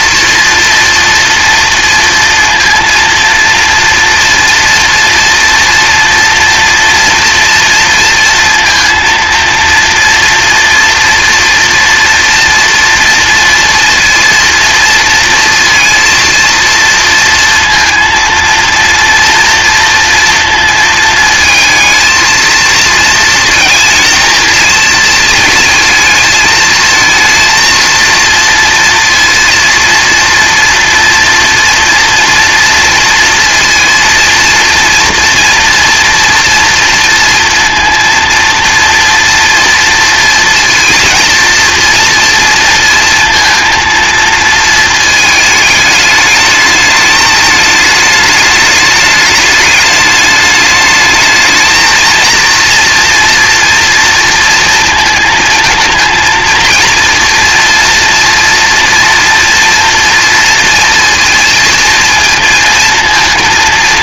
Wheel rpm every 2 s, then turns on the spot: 240, 230, 230, 230, 230, 230, 230, 230, 230, 230, 220, 230, 230, 220, 230, 240, 230, 240, 230, 230, 230, 230, 220, 210, 210, 210, 230, 230, 230, 230, 230, 230.
none